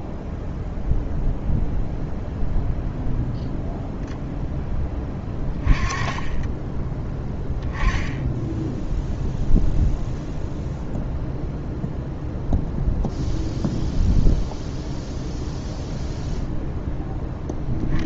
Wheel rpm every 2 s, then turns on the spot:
0, 0, 10, 20, 0, 0, 0, 0, 0.
none